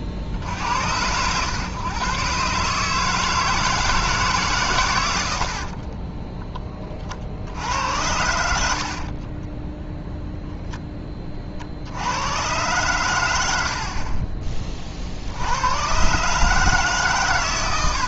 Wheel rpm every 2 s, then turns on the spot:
70, 140, 130, 20, 70, 0, 100, 30, 150.
none